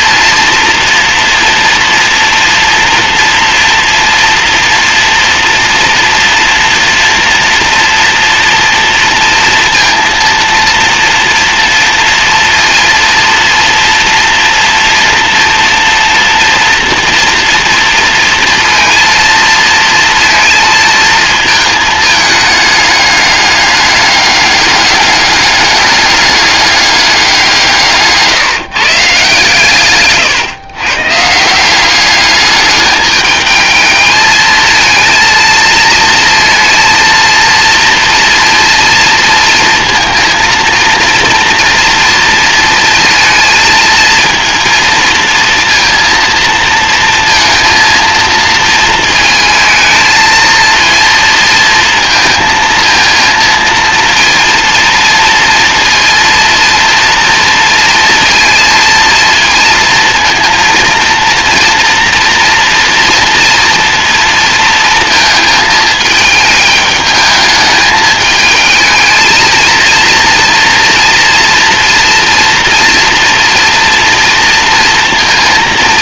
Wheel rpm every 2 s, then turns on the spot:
230, 240, 230, 230, 230, 230, 230, 230, 230, 230, 230, 210, 210, 200, 150, 130, 210, 230, 230, 230, 230, 230, 230, 230, 220, 230, 230, 230, 230, 230, 230, 230, 230, 220, 220, 230, 230, 230.
none